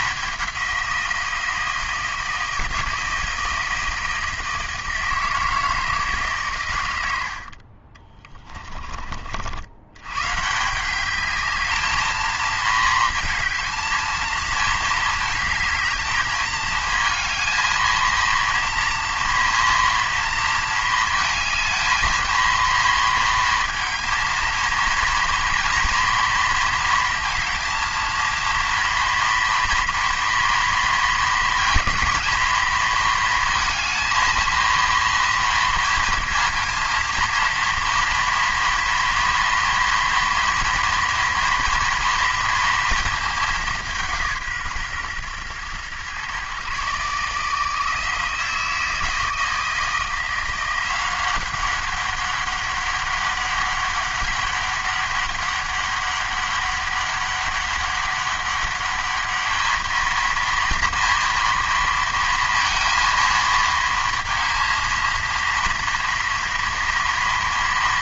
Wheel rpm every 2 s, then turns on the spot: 190, 160, 160, 110, 30, 160, 220, 220, 220, 230, 230, 230, 230, 230, 230, 230, 230, 230, 230, 230, 230, 230, 140, 140, 160, 180, 200, 200, 200, 200, 230, 230, 230, 230.
none